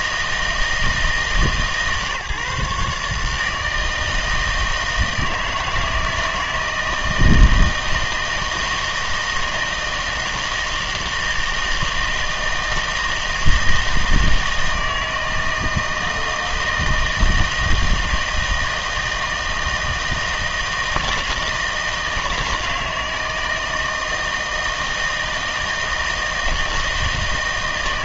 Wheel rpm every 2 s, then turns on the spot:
160, 140, 160, 160, 160, 160, 160, 160, 160, 160, 160, 160, 160, 160.
none